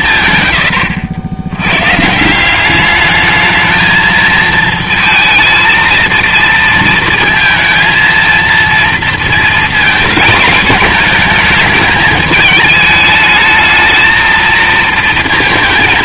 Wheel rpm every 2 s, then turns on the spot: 120, 190, 220, 230, 230, 220, 210, 230.
none